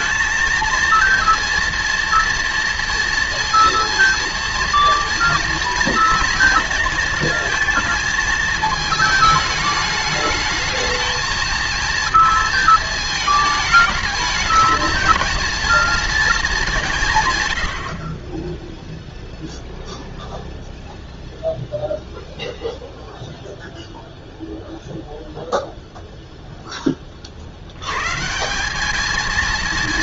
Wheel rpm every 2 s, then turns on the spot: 230, 230, 230, 230, 220, 220, 230, 220, 200, 10, 0, 0, 0, 0, 170.
none